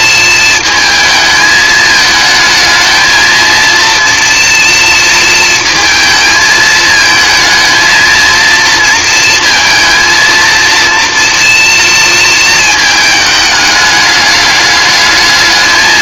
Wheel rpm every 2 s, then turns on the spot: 230, 220, 230, 220, 230, 230, 230, 210.
none